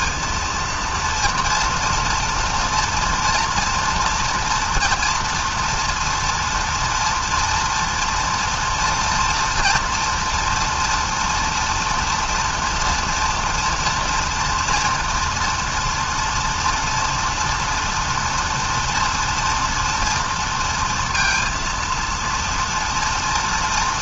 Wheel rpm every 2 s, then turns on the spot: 230, 230, 240, 230, 230, 240, 230, 230, 230, 240, 230, 230.
none